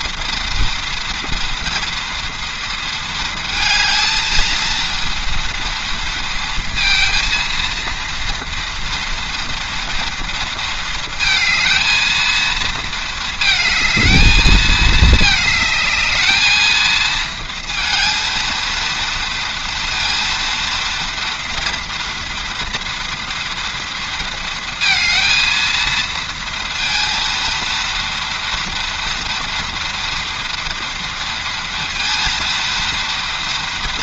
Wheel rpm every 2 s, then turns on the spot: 230, 230, 230, 230, 230, 230, 220, 220, 220, 230, 230, 240, 230, 230, 230, 230, 230.
none